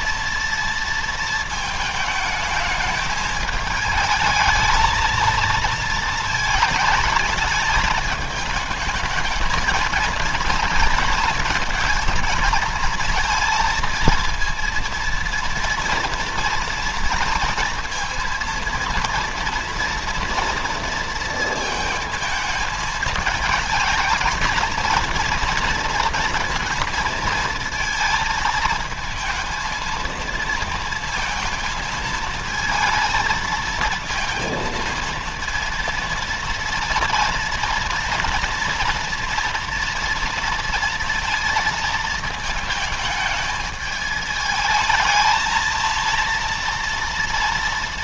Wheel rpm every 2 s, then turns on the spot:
230, 220, 220, 220, 220, 230, 230, 230, 230, 230, 230, 220, 230, 230, 220, 230, 230, 230, 230, 230, 230, 220, 220, 230.
none